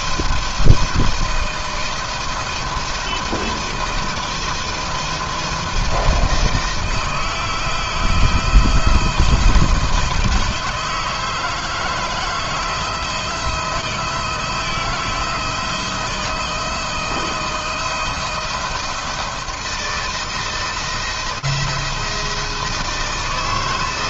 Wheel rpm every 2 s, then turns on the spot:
160, 170, 160, 160, 160, 160, 160, 160, 160, 160, 160, 150.
none